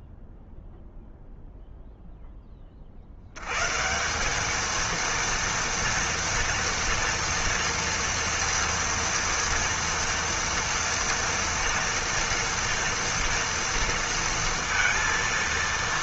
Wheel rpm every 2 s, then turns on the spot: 0, 20, 210, 230, 230, 230, 230, 230.
none